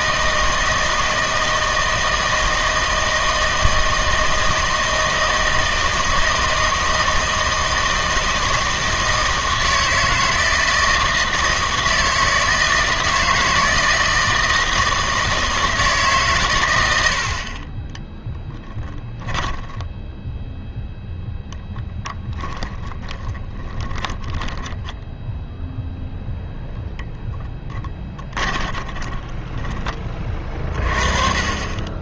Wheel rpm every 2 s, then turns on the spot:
160, 160, 160, 160, 160, 160, 160, 160, 110, 20, 0, 10, 10, 0, 20, 30.
18-20 22-26 28-30